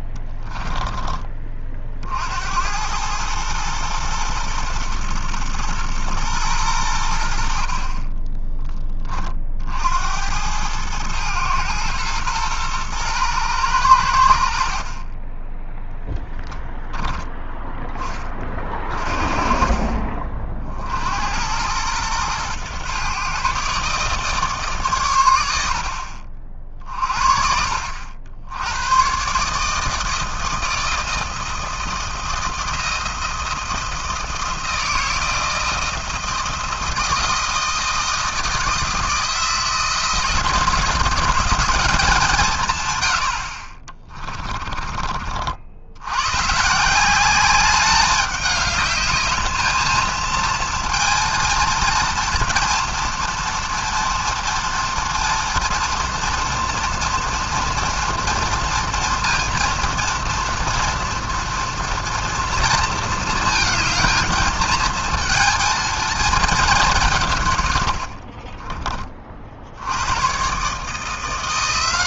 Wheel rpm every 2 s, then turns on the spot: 30, 50, 120, 120, 40, 60, 120, 100, 0, 10, 30, 110, 150, 60, 60, 160, 170, 160, 160, 160, 170, 190, 30, 80, 200, 220, 230, 230, 230, 230, 230, 230, 220, 230, 90, 80.
none